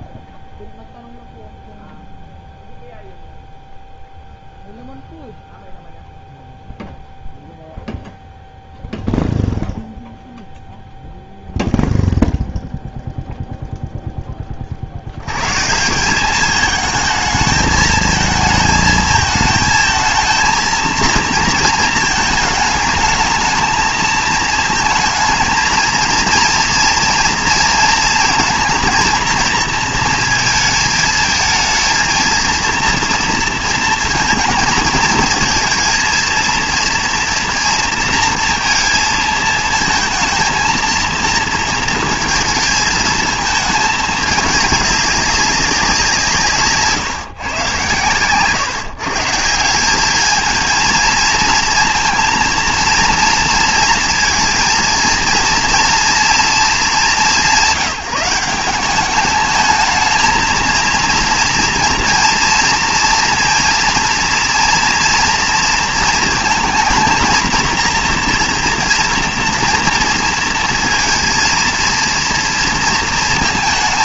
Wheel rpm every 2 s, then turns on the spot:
0, 0, 0, 0, 0, 0, 0, 30, 210, 220, 220, 220, 220, 230, 230, 220, 230, 220, 230, 230, 230, 220, 210, 150, 120, 220, 230, 230, 220, 190, 230, 230, 230, 230, 230, 230, 230.
none